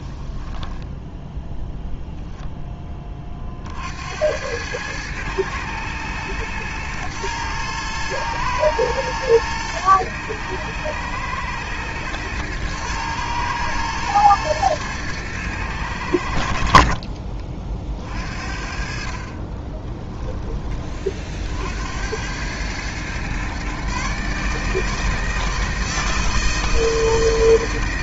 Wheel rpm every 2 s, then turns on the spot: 0, 20, 110, 110, 110, 110, 110, 110, 40, 40, 30, 120, 160, 160.
16-18